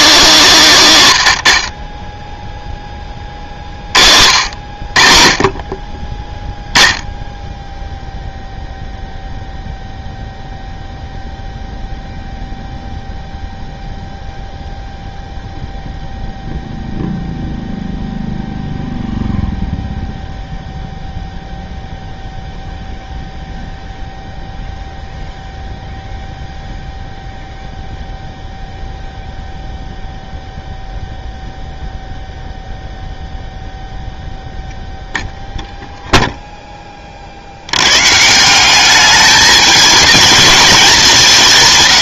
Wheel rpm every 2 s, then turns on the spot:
130, 30, 60, 0, 0, 0, 0, 0, 0, 0, 0, 0, 0, 0, 0, 0, 0, 0, 10, 180, 210.
none